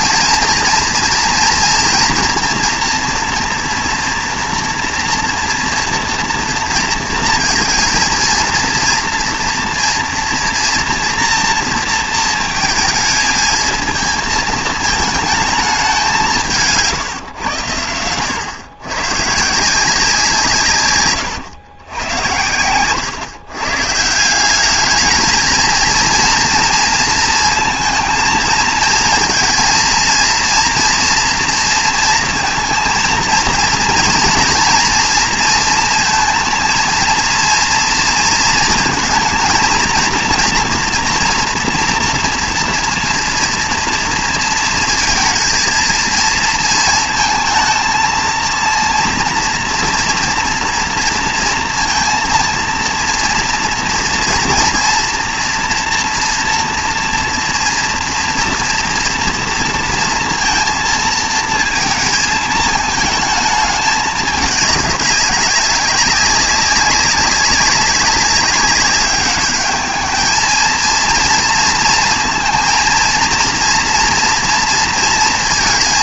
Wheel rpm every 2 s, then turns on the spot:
230, 230, 230, 230, 230, 230, 230, 220, 160, 110, 160, 100, 200, 230, 220, 230, 230, 230, 230, 230, 240, 230, 230, 230, 230, 230, 230, 230, 230, 230, 230, 220, 200, 200, 200, 220, 230, 230.
none